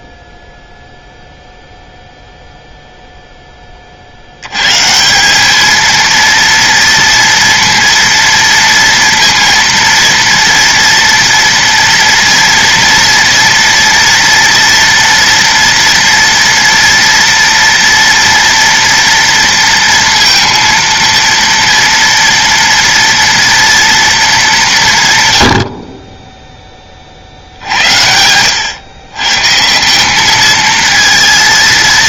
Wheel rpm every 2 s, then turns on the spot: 0, 0, 120, 230, 230, 230, 230, 230, 230, 230, 230, 230, 190, 20, 110, 220.
none